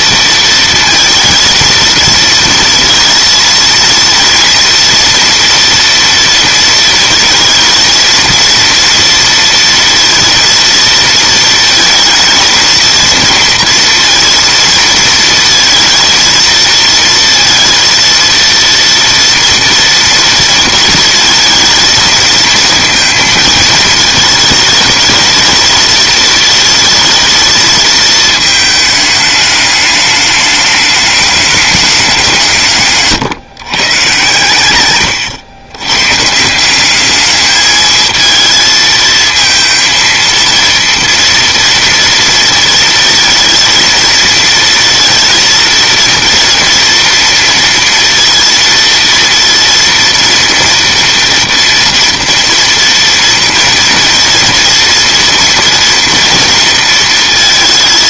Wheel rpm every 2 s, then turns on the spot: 230, 230, 230, 230, 230, 230, 220, 230, 230, 230, 230, 230, 220, 220, 220, 210, 150, 120, 180, 220, 230, 230, 230, 230, 230, 230, 230, 230, 230.
none